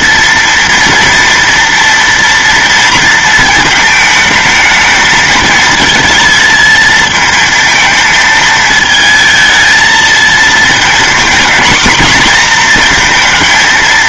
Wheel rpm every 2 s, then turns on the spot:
230, 230, 220, 220, 220, 230, 230.
none